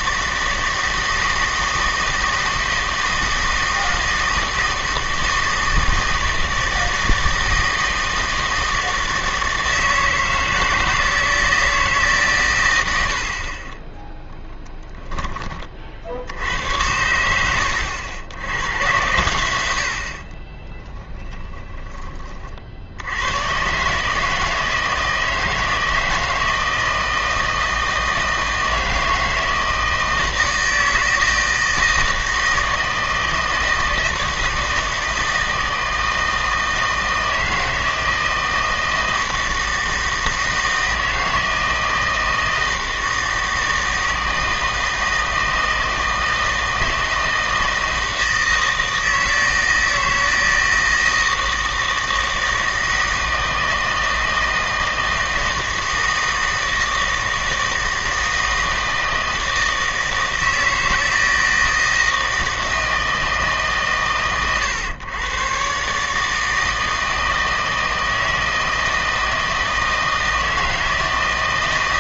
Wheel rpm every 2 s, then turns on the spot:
160, 160, 160, 160, 160, 160, 100, 20, 90, 100, 20, 60, 160, 160, 160, 160, 160, 160, 160, 160, 160, 160, 160, 160, 160, 160, 160, 160, 160, 160, 160, 160, 120, 160, 160, 160.
14-16 20-22